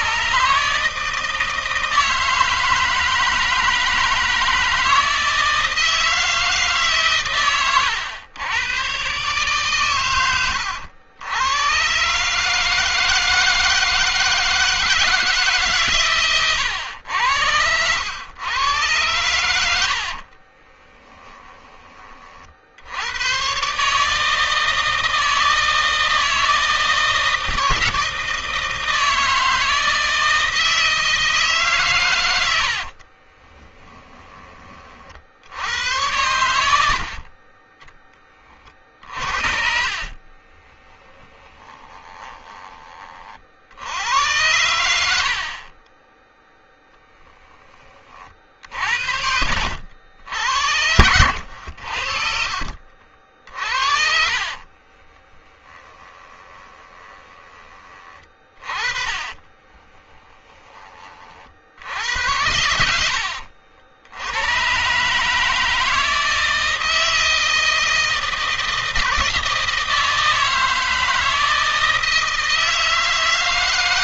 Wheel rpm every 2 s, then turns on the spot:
150, 160, 160, 140, 120, 90, 160, 160, 90, 100, 20, 80, 160, 160, 160, 160, 60, 40, 80, 30, 30, 30, 90, 10, 70, 80, 50, 30, 20, 40, 20, 80, 130, 160, 160, 160, 160.
20-22 32-34 36-38 40-42 48-52 54-60